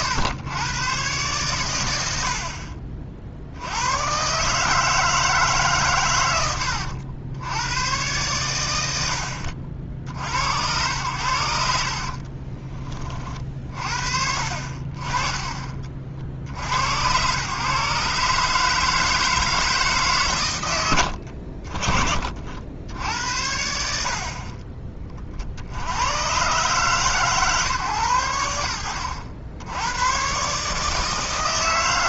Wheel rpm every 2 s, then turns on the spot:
110, 50, 150, 100, 100, 90, 20, 50, 80, 150, 110, 60, 30, 120, 90, 150.
none